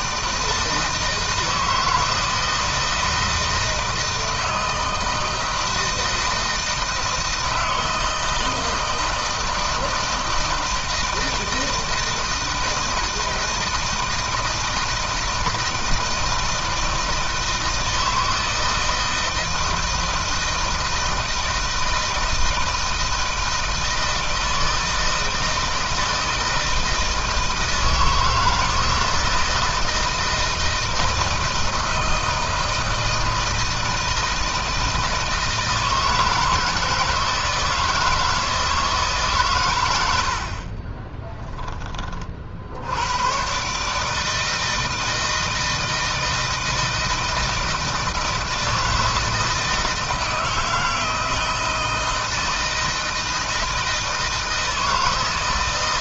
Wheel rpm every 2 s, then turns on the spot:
160, 160, 160, 170, 160, 160, 160, 160, 160, 160, 160, 160, 160, 160, 160, 160, 160, 160, 160, 160, 40, 70, 160, 160, 160, 160, 160, 160.
40-42